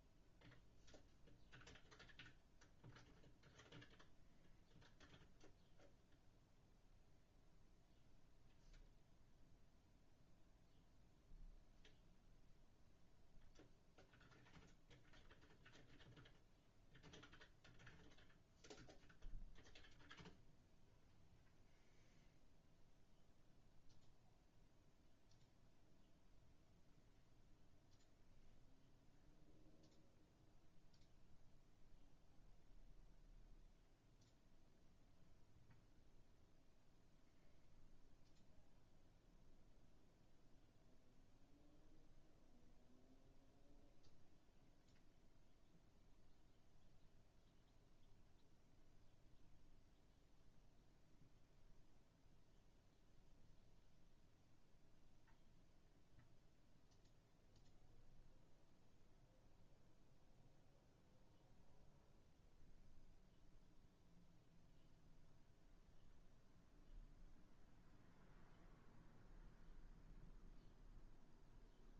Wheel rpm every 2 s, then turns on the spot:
0, 0, 0, 0, 0, 0, 0, 0, 0, 0, 0, 0, 0, 0, 0, 0, 0, 0, 0, 0, 0, 0, 0, 0, 0, 0, 0, 0, 0, 0, 0, 0, 0, 0, 0, 0.
none